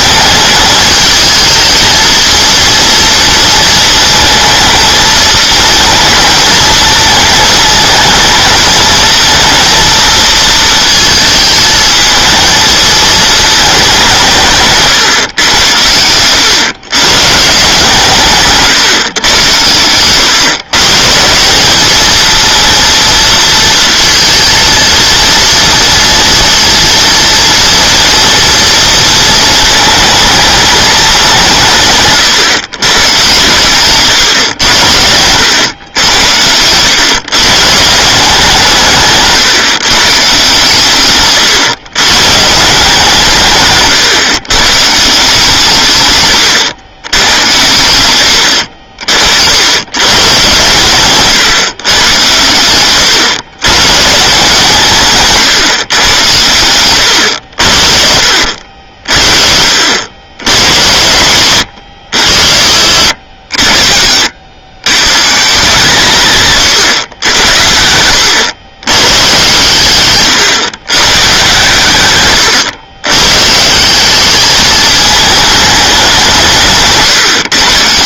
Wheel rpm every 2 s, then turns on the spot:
210, 230, 220, 230, 220, 220, 220, 140, 120, 140, 140, 230, 230, 230, 230, 220, 120, 90, 100, 150, 130, 150, 130, 120, 70, 130, 110, 160, 90, 70, 100, 100, 110, 120, 110, 140, 100, 210, 170.
48-50